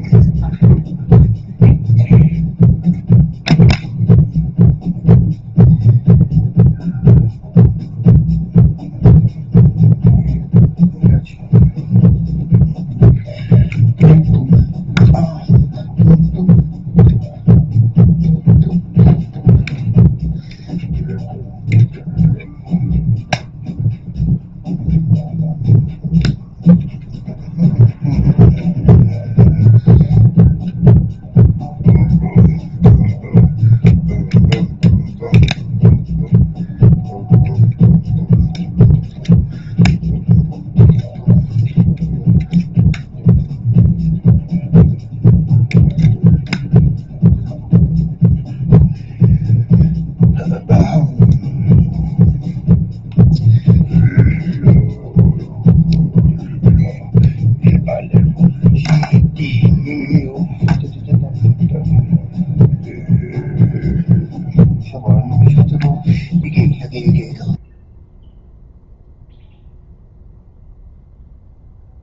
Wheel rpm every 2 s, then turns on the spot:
0, 0, 0, 0, 0, 0, 0, 0, 0, 0, 0, 0, 0, 0, 0, 0, 0, 0, 0, 0, 0, 0, 0, 0, 0, 0, 0, 0, 0, 0, 0, 0, 0, 0, 0, 0.
none